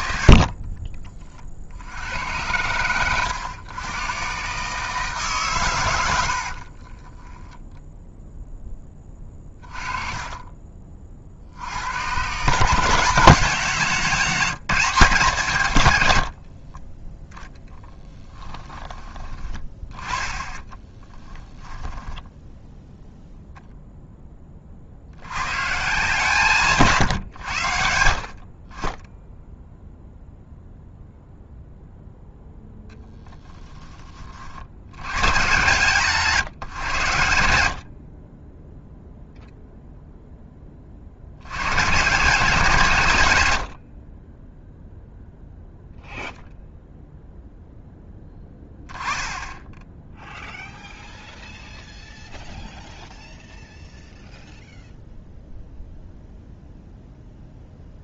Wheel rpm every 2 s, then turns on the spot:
60, 100, 150, 30, 10, 40, 190, 190, 20, 10, 10, 0, 60, 140, 20, 0, 0, 90, 130, 0, 50, 150, 0, 0, 10, 0, 0, 0, 0.
6-10 16-18 20-22